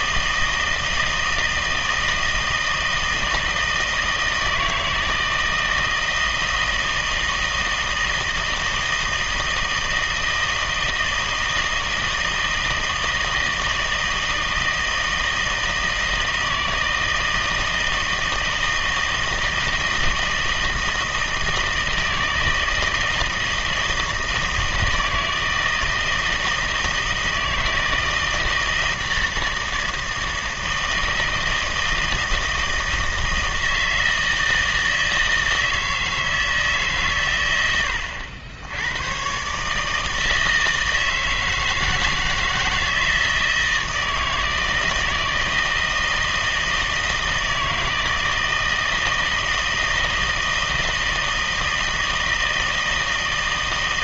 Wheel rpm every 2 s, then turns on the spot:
160, 160, 160, 160, 160, 160, 160, 160, 160, 160, 160, 160, 160, 160, 160, 160, 160, 160, 150, 90, 160, 160, 160, 160, 160, 160, 160.
none